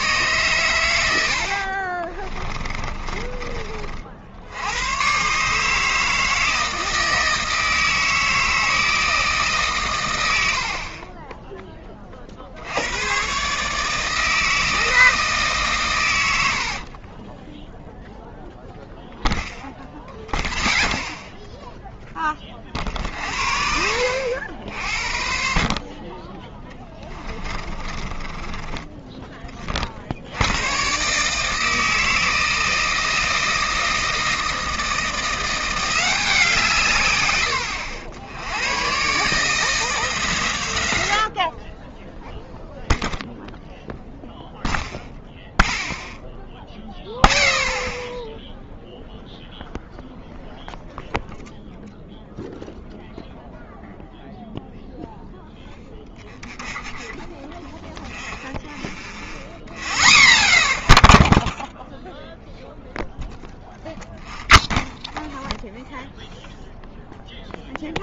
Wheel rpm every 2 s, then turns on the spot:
110, 30, 90, 160, 160, 70, 70, 160, 70, 0, 0, 40, 60, 10, 20, 100, 160, 170, 160, 100, 110, 0, 0, 0, 0, 0, 0, 0, 0, 0, 0, 0, 0, 0.
2-4 10-12 16-18